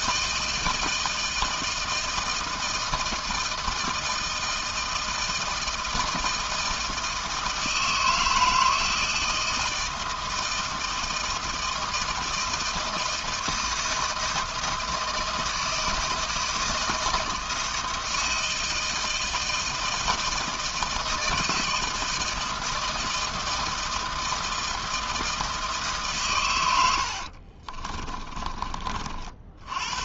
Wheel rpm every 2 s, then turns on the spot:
160, 170, 160, 160, 160, 160, 160, 160, 160, 160, 160, 160, 160, 100, 40.
26-28